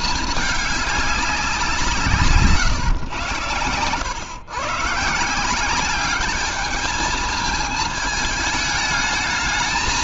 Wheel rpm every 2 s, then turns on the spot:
210, 140, 120, 210, 220.
none